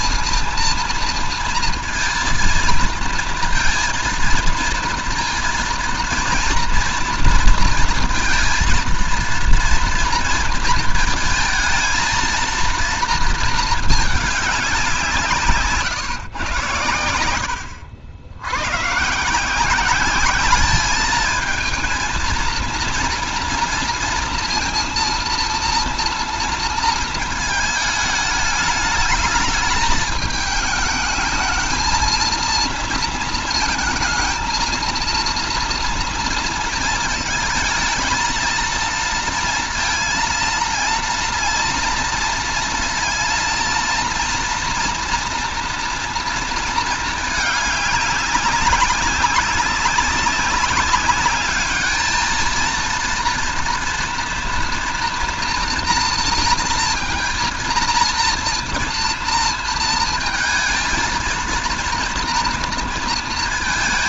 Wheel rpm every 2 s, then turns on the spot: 230, 230, 230, 230, 230, 230, 230, 190, 110, 90, 200, 230, 230, 230, 210, 220, 230, 230, 230, 230, 230, 230, 230, 230, 200, 200, 220, 230, 230, 230, 230, 230.
none